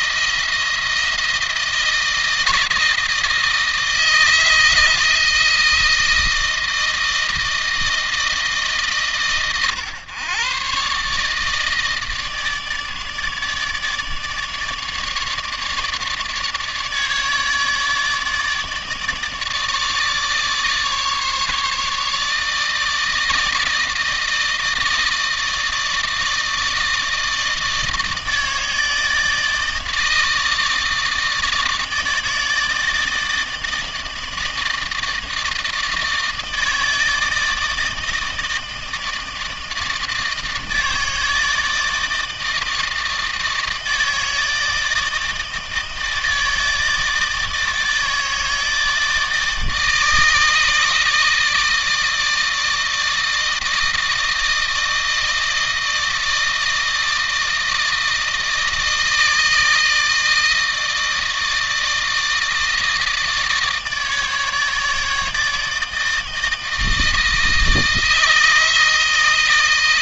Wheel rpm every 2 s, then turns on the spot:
170, 160, 160, 160, 150, 130, 160, 150, 150, 150, 150, 160, 160, 160, 160, 160, 150, 160, 160, 160, 160, 160, 160, 160, 160, 160, 160, 160, 160, 160, 160, 160, 150, 160, 160.
none